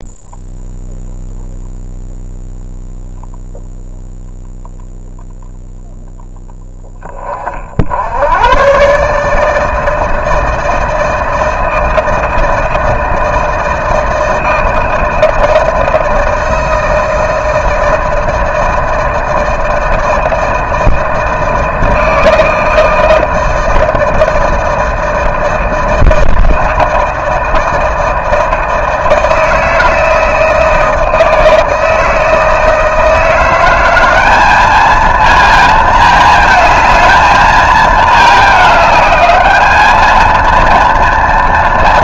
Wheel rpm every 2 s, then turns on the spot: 0, 0, 0, 0, 90, 160, 160, 170, 160, 160, 160, 160, 160, 160, 160, 160, 160, 190, 220, 220, 220.
none